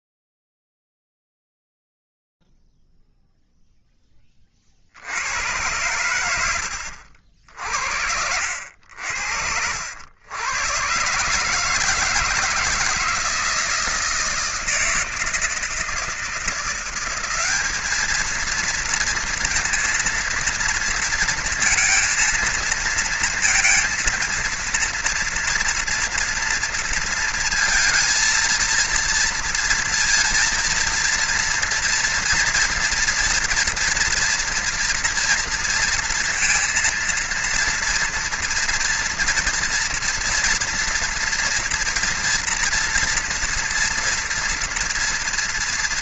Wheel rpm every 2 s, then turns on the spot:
0, 0, 30, 90, 80, 110, 160, 160, 170, 220, 230, 230, 230, 230, 230, 230, 230, 230, 230, 230, 230, 240, 230.
none